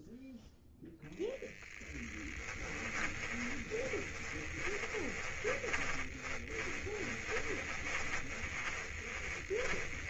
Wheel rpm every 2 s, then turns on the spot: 0, 10, 20, 30, 20.
2-10